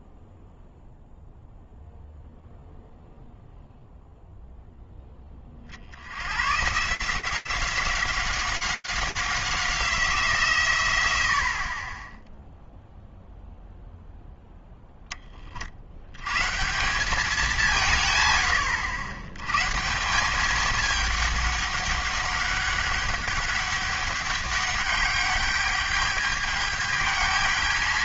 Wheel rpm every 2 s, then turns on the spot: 0, 0, 20, 180, 190, 70, 0, 50, 150, 150, 200, 200, 210, 220.
none